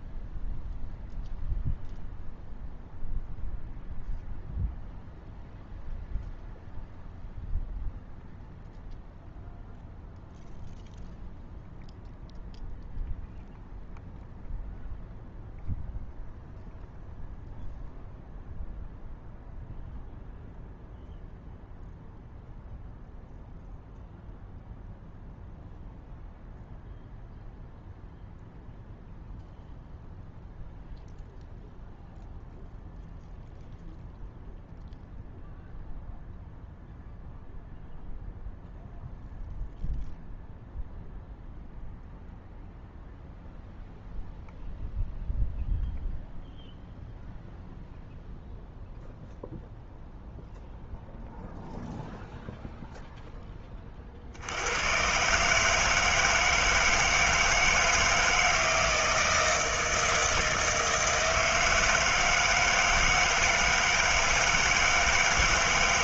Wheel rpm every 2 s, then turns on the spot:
0, 0, 0, 0, 0, 0, 0, 0, 0, 0, 0, 0, 0, 0, 0, 0, 0, 0, 0, 0, 0, 0, 0, 0, 0, 0, 0, 40, 160, 160, 160, 160, 160.
none